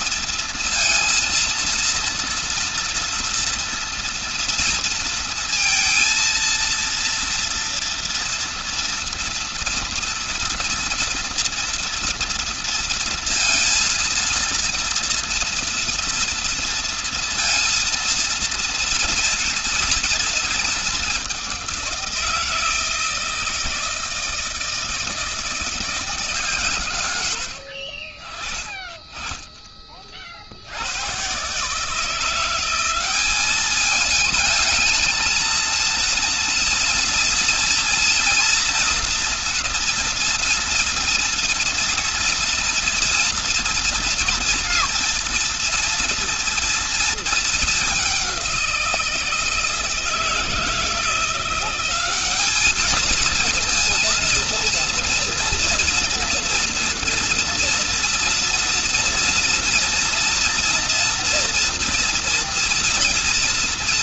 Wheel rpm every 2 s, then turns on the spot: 230, 230, 230, 230, 230, 230, 230, 230, 230, 230, 210, 160, 160, 110, 20, 110, 200, 220, 230, 230, 230, 230, 230, 230, 170, 170, 230, 230, 230, 240, 230, 230.
none